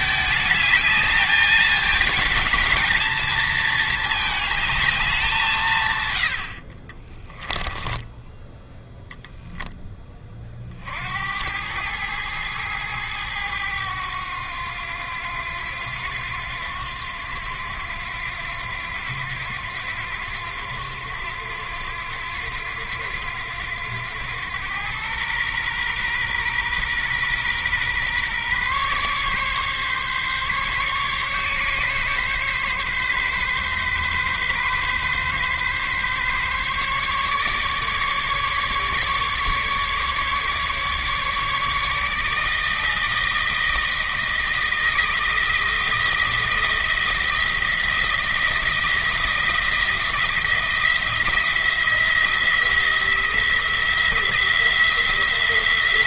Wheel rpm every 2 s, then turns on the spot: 220, 220, 210, 40, 10, 60, 110, 90, 90, 90, 90, 90, 110, 120, 140, 140, 140, 130, 140, 150, 150, 160, 160, 160, 170, 170, 170, 170.
6-8